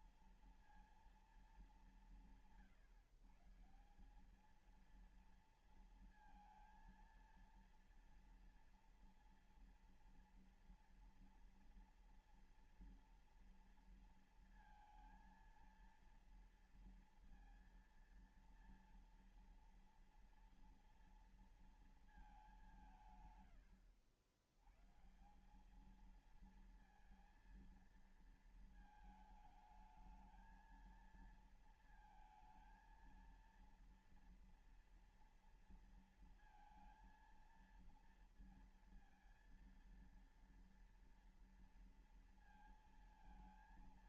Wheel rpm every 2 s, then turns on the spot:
230, 160, 210, 230, 230, 230, 230, 230, 230, 230, 230, 200, 100, 220, 220, 220, 220, 230, 230, 230, 230, 230.
none